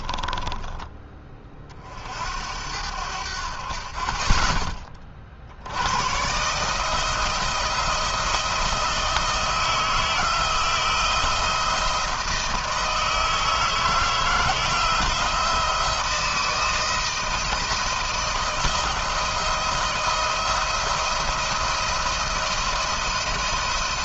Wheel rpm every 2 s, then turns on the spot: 20, 80, 30, 160, 160, 170, 160, 170, 160, 170, 170, 170.
none